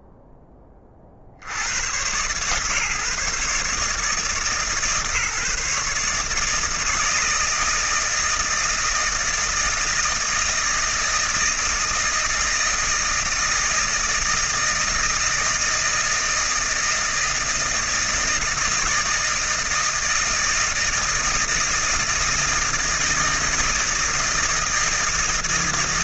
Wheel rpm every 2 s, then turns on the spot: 10, 140, 150, 160, 160, 160, 160, 160, 160, 170, 160, 160, 160.
none